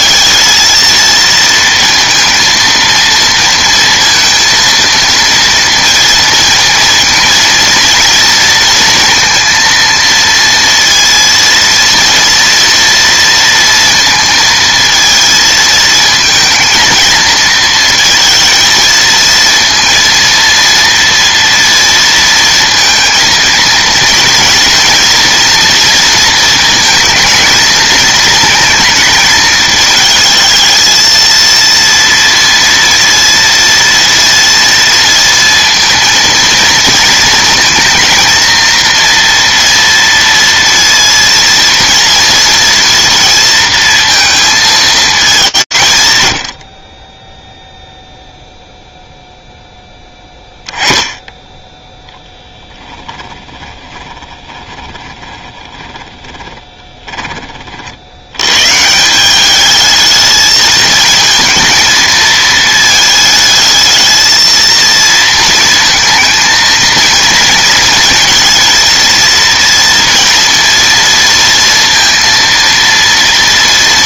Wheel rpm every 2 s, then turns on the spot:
230, 230, 230, 230, 230, 230, 230, 230, 230, 230, 240, 230, 230, 220, 220, 220, 230, 230, 230, 230, 230, 230, 220, 50, 0, 10, 10, 20, 20, 140, 220, 220, 230, 220, 230, 230, 230.
52-58